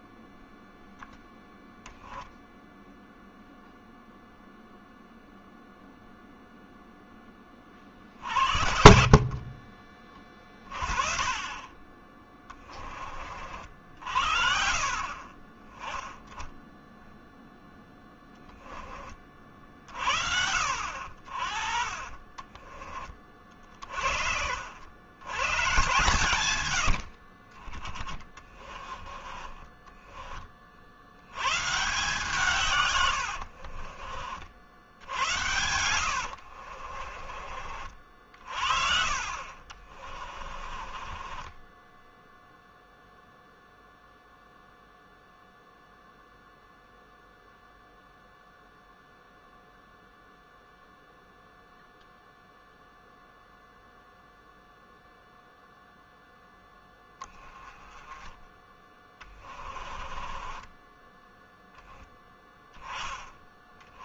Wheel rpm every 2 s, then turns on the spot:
0, 0, 0, 0, 40, 20, 40, 40, 0, 20, 60, 20, 90, 70, 20, 70, 110, 70, 40, 40, 30, 0, 0, 0, 0, 0, 0, 0, 10, 20, 10, 10.
8-10 32-34 36-42 58-62